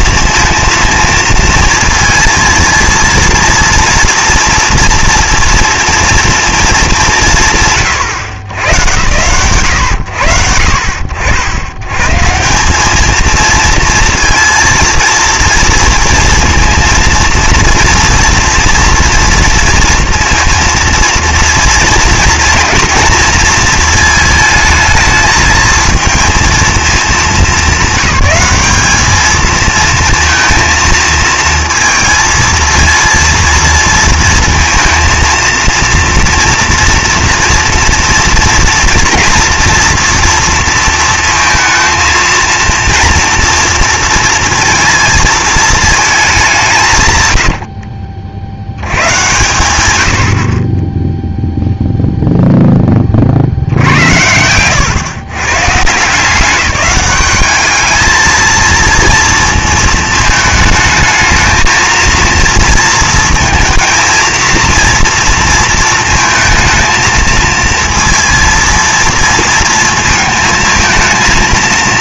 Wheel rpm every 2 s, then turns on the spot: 220, 230, 230, 170, 120, 70, 220, 230, 230, 230, 230, 230, 220, 210, 220, 230, 230, 230, 230, 230, 230, 230, 230, 100, 110, 10, 10, 110, 200, 230, 220, 230, 230, 230, 230, 230.
none